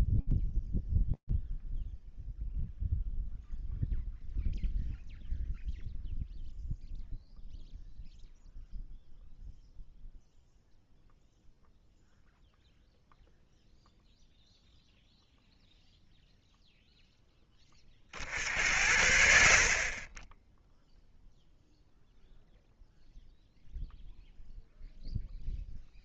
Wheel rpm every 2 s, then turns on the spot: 0, 0, 0, 0, 0, 0, 0, 0, 60, 0, 0, 0, 30.
none